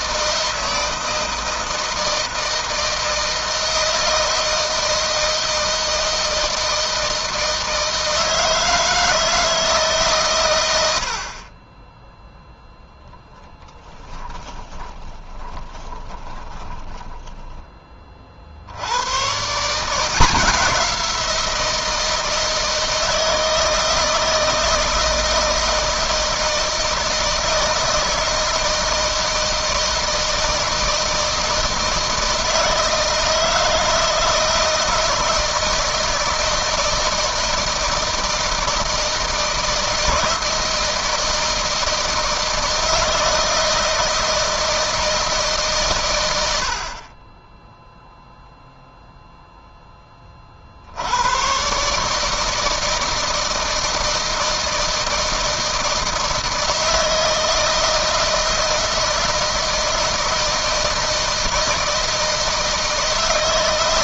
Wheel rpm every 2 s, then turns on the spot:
160, 160, 160, 160, 160, 80, 0, 20, 10, 100, 180, 160, 160, 160, 160, 160, 160, 160, 160, 160, 160, 160, 160, 40, 0, 80, 160, 160, 160, 160, 160, 160.
14-18